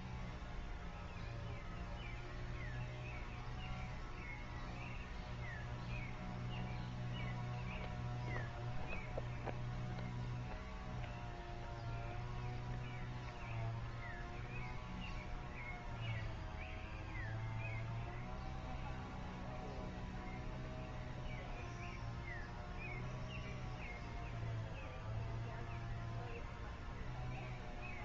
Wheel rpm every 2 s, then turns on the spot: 0, 0, 0, 0, 0, 0, 0, 0, 0, 0, 0, 0, 0, 0.
none